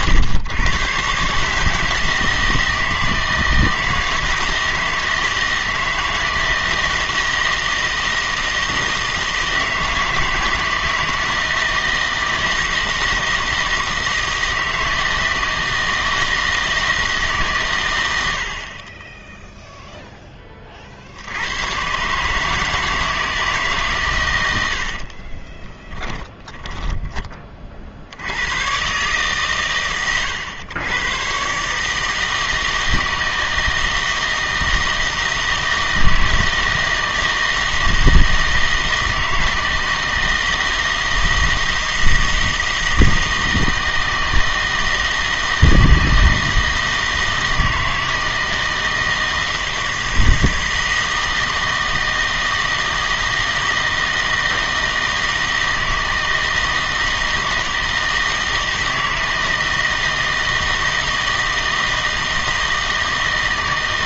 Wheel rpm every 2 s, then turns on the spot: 120, 160, 160, 160, 160, 160, 160, 160, 160, 40, 40, 160, 70, 10, 120, 110, 160, 160, 160, 160, 160, 160, 160, 160, 160, 160, 160, 160, 160, 160, 160, 160.
24-28